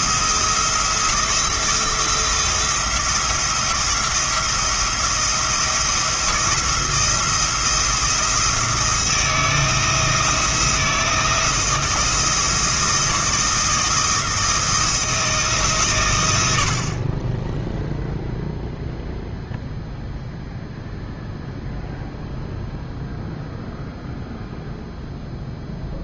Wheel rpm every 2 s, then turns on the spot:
170, 170, 170, 170, 160, 170, 170, 170, 60, 0, 0, 0, 0.
none